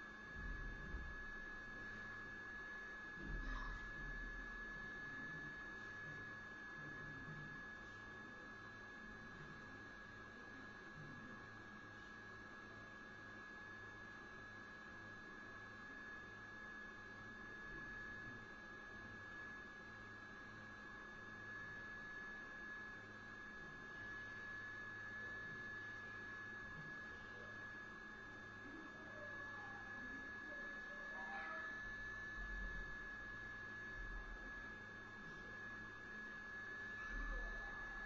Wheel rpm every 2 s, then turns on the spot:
0, 0, 0, 0, 0, 0, 0, 0, 0, 0, 0, 0, 0, 0, 0, 0, 0, 0, 0.
none